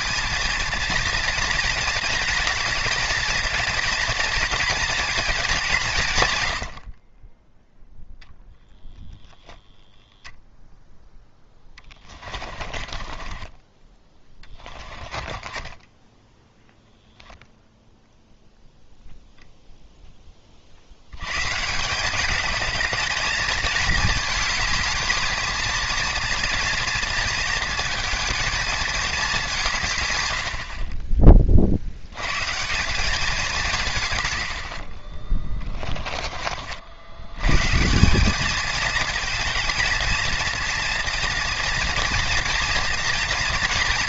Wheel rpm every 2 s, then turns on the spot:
230, 230, 230, 70, 0, 0, 30, 20, 10, 0, 60, 220, 220, 240, 220, 50, 190, 40, 50, 220, 230, 230.
6-8 12-16